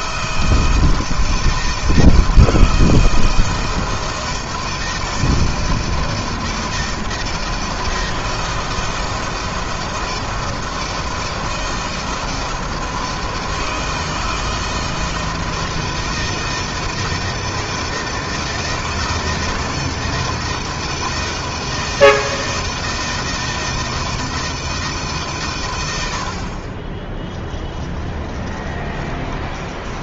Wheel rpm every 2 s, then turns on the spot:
160, 160, 160, 160, 160, 160, 160, 160, 160, 160, 160, 160, 150, 30, 20.
26-30